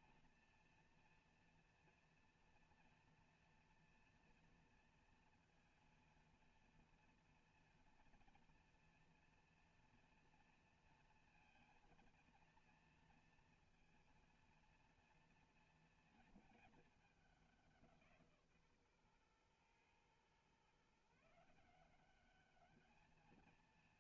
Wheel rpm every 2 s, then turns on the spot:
230, 230, 230, 230, 230, 230, 230, 230, 230, 150, 130, 210.
none